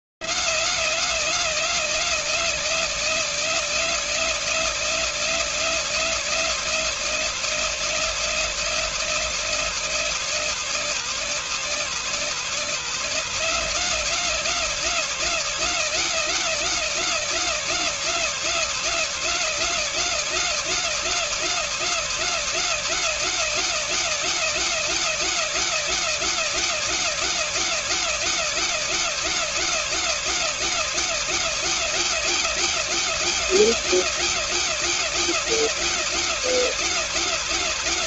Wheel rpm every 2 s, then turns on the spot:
260, 250, 240, 240, 240, 240, 240, 250, 250, 250, 250, 250, 250, 250, 250, 250, 250, 250, 250.
none